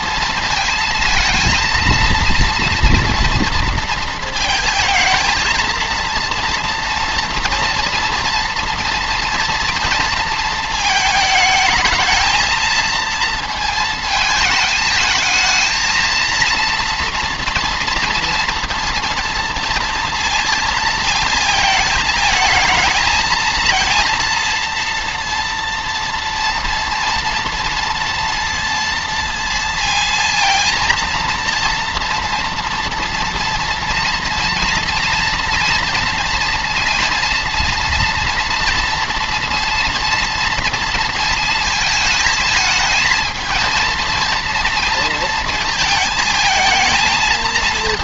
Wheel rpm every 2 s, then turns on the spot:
230, 230, 230, 230, 230, 220, 230, 220, 230, 230, 230, 220, 230, 230, 230, 230, 230, 230, 230, 230, 230, 220, 230, 220.
none